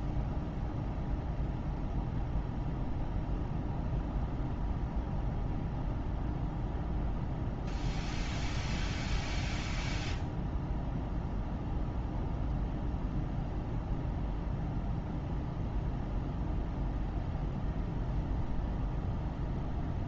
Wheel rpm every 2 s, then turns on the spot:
0, 0, 0, 0, 0, 0, 0, 0, 0, 0.
none